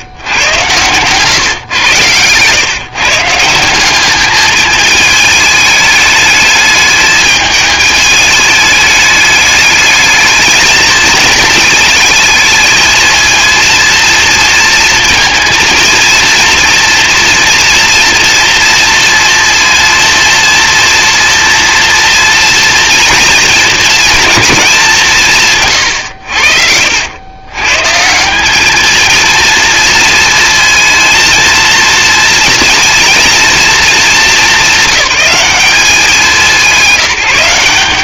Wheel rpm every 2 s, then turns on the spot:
120, 140, 220, 210, 210, 220, 220, 230, 230, 230, 230, 230, 190, 70, 210, 230, 230, 200, 170.
none